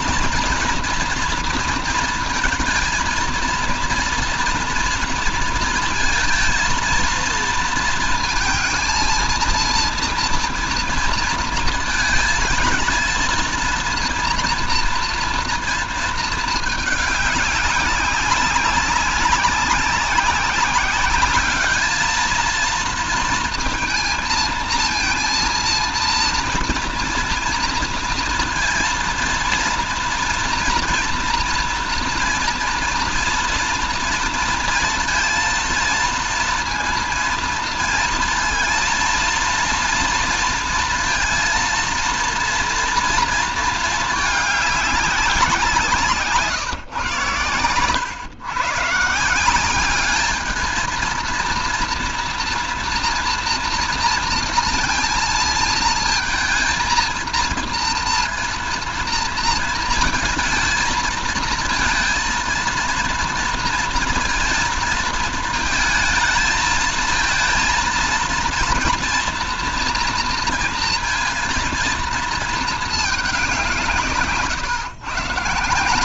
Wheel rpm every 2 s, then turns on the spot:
230, 230, 240, 230, 230, 240, 220, 230, 210, 190, 200, 230, 230, 230, 230, 230, 230, 230, 230, 230, 230, 230, 210, 140, 130, 220, 230, 230, 220, 230, 220, 230, 230, 220, 230, 230, 220, 140.
none